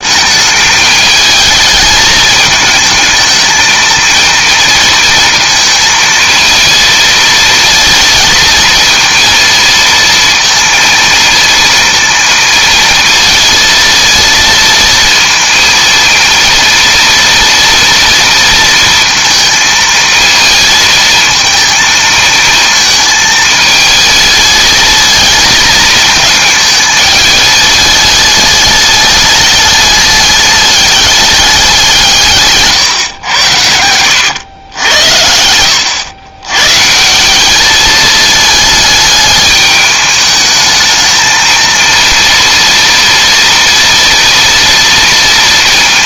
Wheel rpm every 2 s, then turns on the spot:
210, 220, 230, 230, 230, 230, 230, 230, 230, 230, 230, 220, 220, 220, 210, 200, 150, 100, 140, 220, 220, 230, 230.
32-34